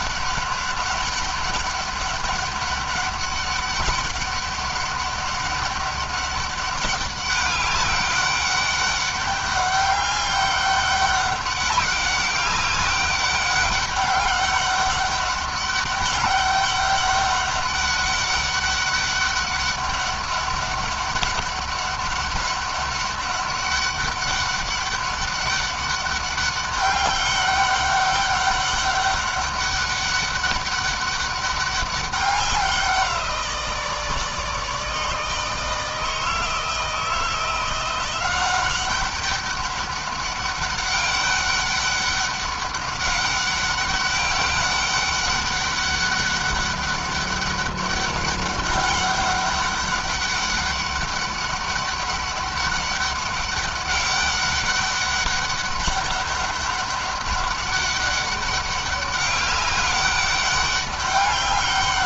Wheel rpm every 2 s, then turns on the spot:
200, 200, 200, 200, 200, 200, 200, 200, 200, 200, 200, 200, 200, 200, 200, 200, 180, 150, 160, 190, 200, 200, 200, 200, 200, 200, 200, 200, 200, 200, 200.
none